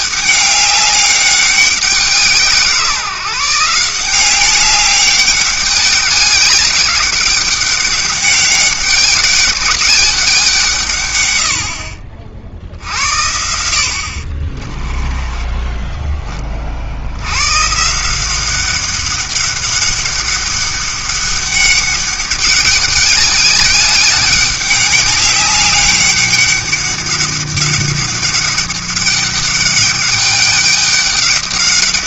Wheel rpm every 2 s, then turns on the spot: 200, 160, 190, 200, 200, 170, 60, 30, 30, 190, 200, 200, 200, 200, 200, 200.
14-16